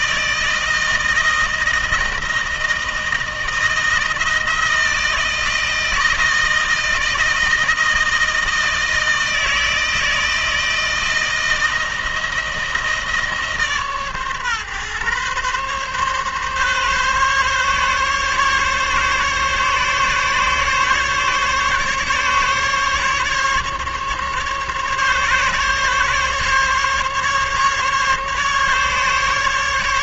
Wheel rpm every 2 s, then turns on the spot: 160, 160, 160, 160, 160, 160, 160, 130, 140, 140, 140, 140, 140, 140, 140.
none